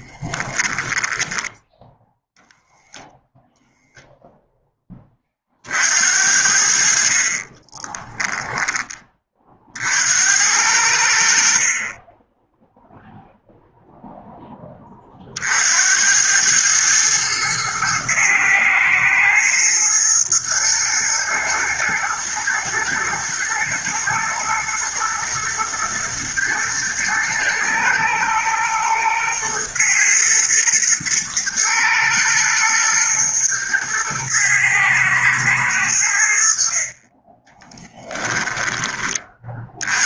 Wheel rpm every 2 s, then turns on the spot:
20, 0, 20, 50, 20, 80, 0, 30, 110, 110, 120, 110, 110, 110, 110, 110, 110, 110, 30, 20.
0-2